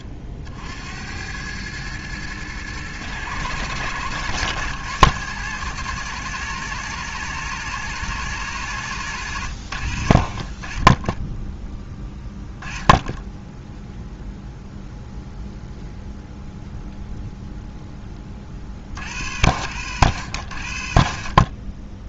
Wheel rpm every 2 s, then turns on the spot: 70, 110, 110, 130, 130, 30, 10, 0, 0, 50, 90.
none